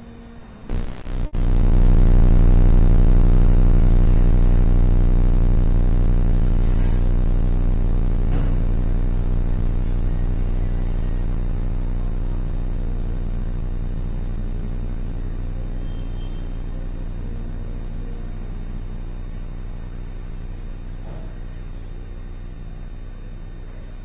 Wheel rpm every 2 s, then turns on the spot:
0, 0, 0, 0, 0, 0, 0, 0, 0, 0, 0, 0.
none